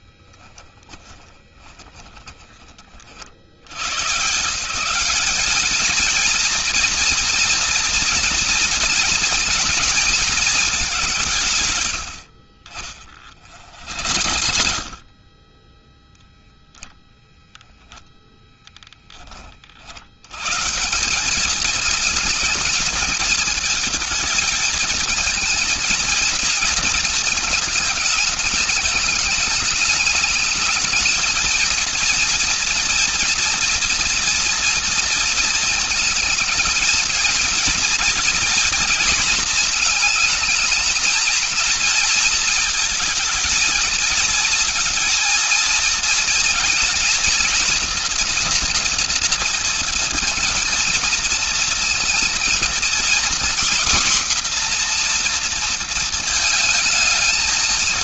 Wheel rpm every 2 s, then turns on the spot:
20, 40, 180, 230, 230, 200, 50, 50, 0, 20, 150, 220, 220, 230, 210, 220, 240, 230, 220, 240, 220, 220, 230, 230, 230, 230, 240, 250, 220.
0-2 12-16